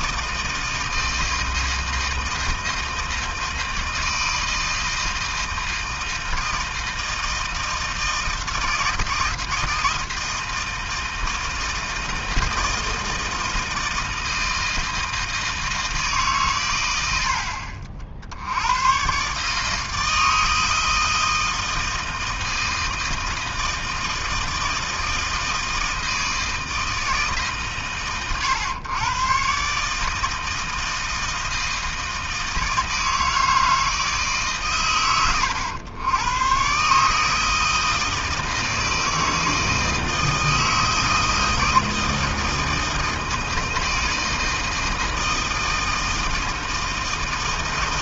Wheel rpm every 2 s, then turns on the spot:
160, 160, 160, 160, 160, 160, 160, 160, 120, 100, 160, 160, 160, 160, 120, 160, 160, 130, 130, 160, 160, 160, 160, 160.
none